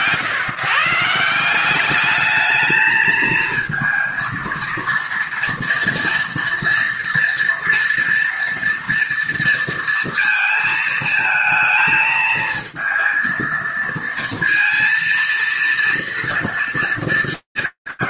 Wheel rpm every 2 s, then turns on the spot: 140, 220, 230, 230, 230, 220, 220, 230, 200.
none